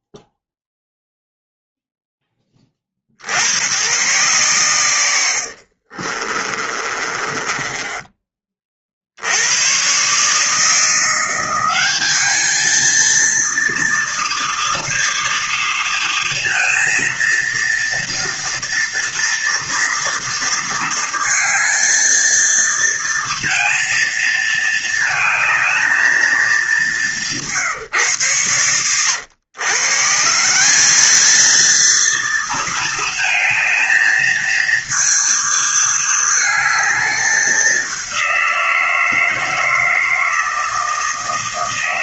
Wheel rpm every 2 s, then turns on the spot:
0, 10, 120, 30, 20, 150, 200, 230, 230, 240, 230, 230, 230, 220, 130, 150, 230, 220, 220, 180, 160.
6-8